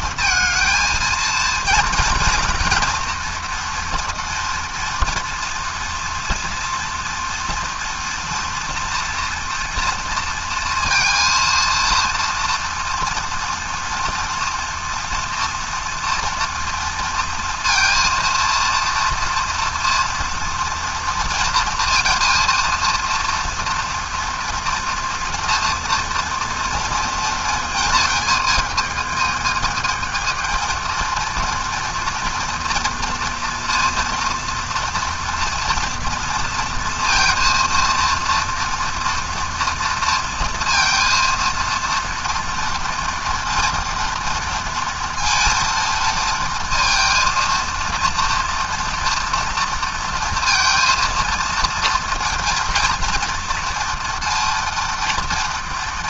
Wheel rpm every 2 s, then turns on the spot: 230, 240, 230, 230, 230, 230, 230, 240, 230, 230, 230, 230, 240, 230, 220, 230, 230, 230, 230, 240, 230, 230, 230, 230, 230, 230, 230, 230.
none